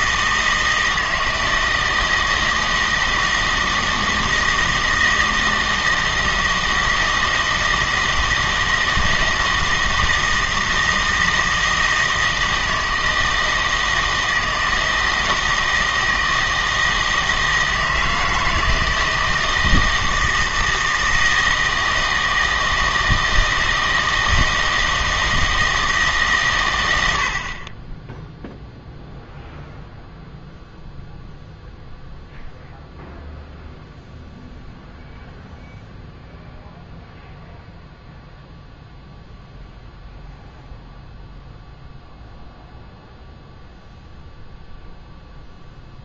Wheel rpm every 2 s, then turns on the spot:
160, 160, 160, 160, 160, 160, 160, 160, 160, 160, 160, 160, 160, 110, 0, 0, 0, 0, 0, 0, 0, 0, 0.
none